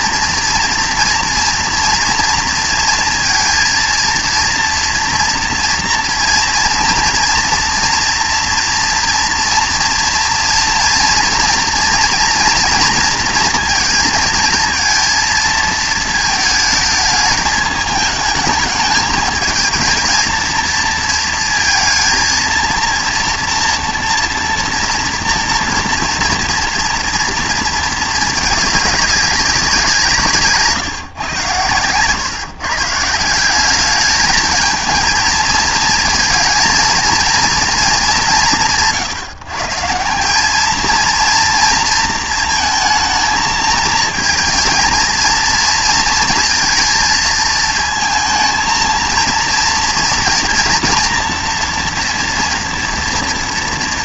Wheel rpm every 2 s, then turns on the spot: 230, 230, 240, 230, 230, 230, 240, 230, 210, 220, 230, 230, 230, 230, 200, 150, 160, 220, 230, 100, 220, 220, 230, 230, 220, 230, 230.
none